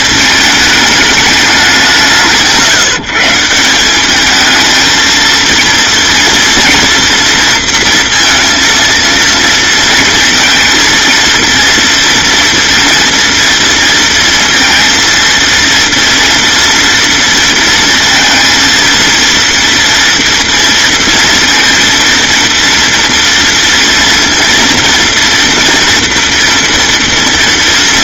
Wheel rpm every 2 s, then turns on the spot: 220, 150, 220, 240, 230, 230, 230, 230, 230, 230, 230, 230, 230, 230.
none